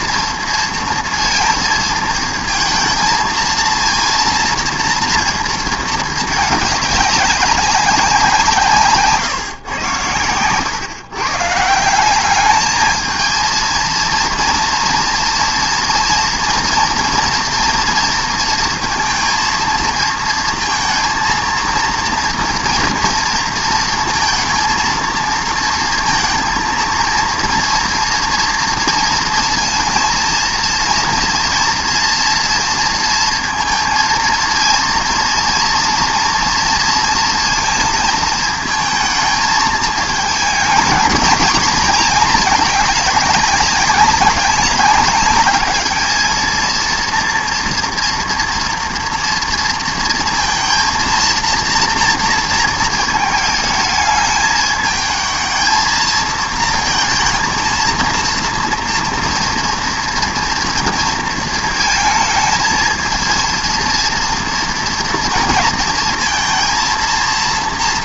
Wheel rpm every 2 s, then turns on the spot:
230, 220, 230, 210, 150, 120, 210, 230, 230, 230, 230, 230, 230, 230, 230, 230, 230, 230, 230, 220, 220, 210, 200, 230, 230, 230, 230, 220, 220, 230, 230, 220, 230, 230.
none